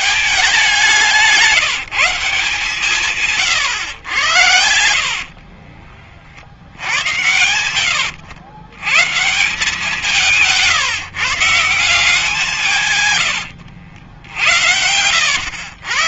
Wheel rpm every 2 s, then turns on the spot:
200, 180, 100, 60, 100, 170, 180, 80.
6-8 14-16